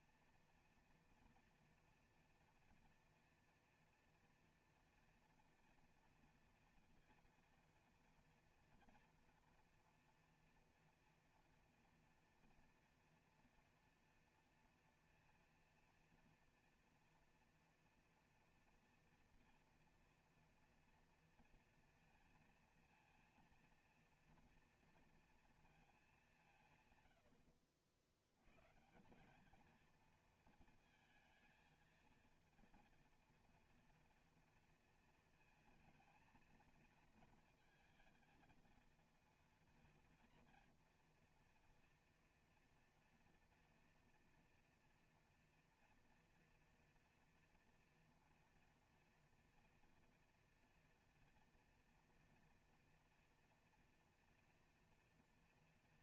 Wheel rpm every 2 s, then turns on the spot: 230, 230, 230, 230, 230, 230, 230, 230, 230, 230, 230, 230, 230, 160, 130, 230, 230, 230, 230, 230, 230, 240, 230, 240, 240, 230, 230, 240.
none